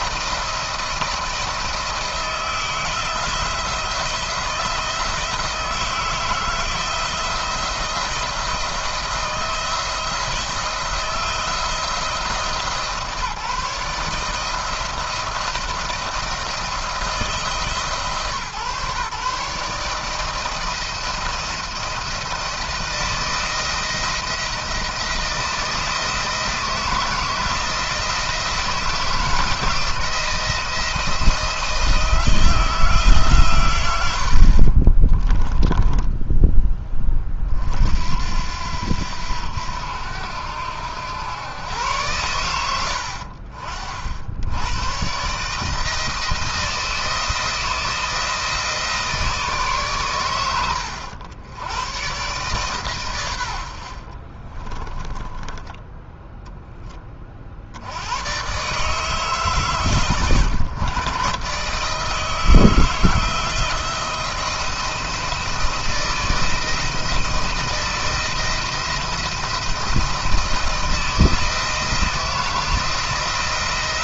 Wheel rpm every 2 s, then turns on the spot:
170, 160, 160, 170, 170, 160, 160, 160, 170, 140, 160, 170, 170, 170, 170, 170, 170, 60, 20, 80, 80, 100, 100, 170, 160, 100, 140, 50, 10, 130, 140, 160, 170, 160, 170, 170, 170.
34-36 54-56